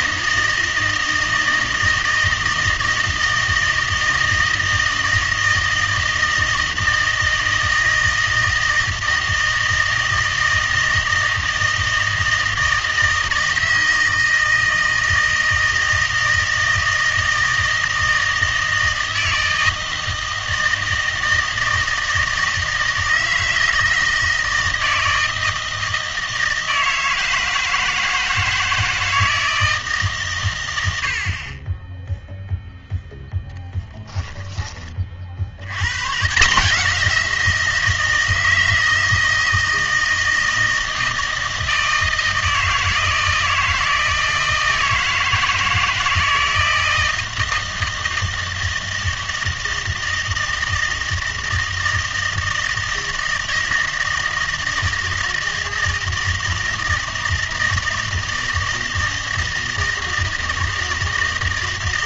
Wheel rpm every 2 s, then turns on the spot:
160, 160, 160, 160, 160, 160, 160, 160, 160, 160, 160, 160, 160, 160, 160, 100, 0, 20, 180, 160, 160, 160, 160, 160, 160, 160, 160, 160, 160, 160, 160.
none